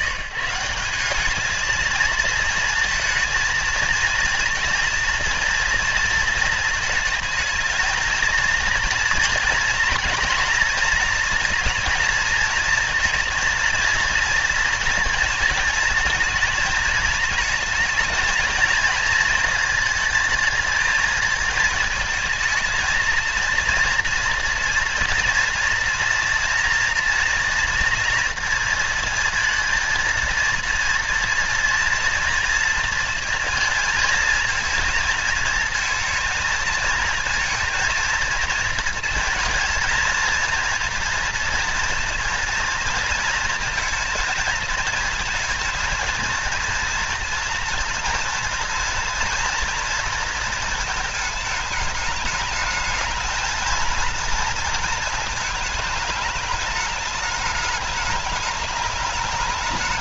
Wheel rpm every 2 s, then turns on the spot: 60, 220, 230, 230, 220, 230, 230, 230, 220, 220, 220, 220, 230, 230, 230, 230, 240, 230, 220, 230, 230, 230, 220, 230, 230, 220, 210, 220, 210, 210.
none